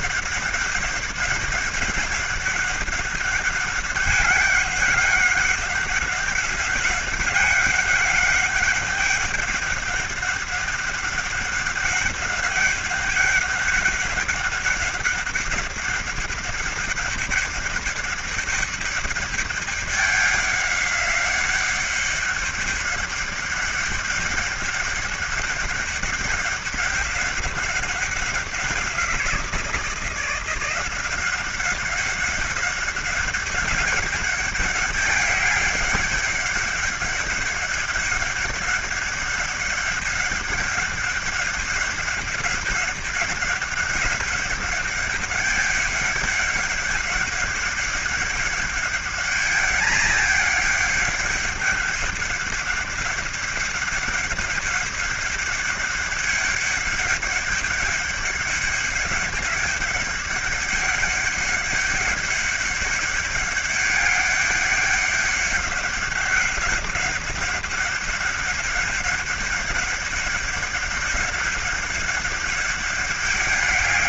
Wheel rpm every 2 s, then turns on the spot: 200, 200, 200, 200, 200, 200, 200, 200, 200, 200, 200, 200, 200, 200, 180, 170, 190, 200, 200, 200, 200, 200, 200, 200, 200, 210, 200, 200, 200, 200, 200, 200, 200, 190, 200, 200, 200.
none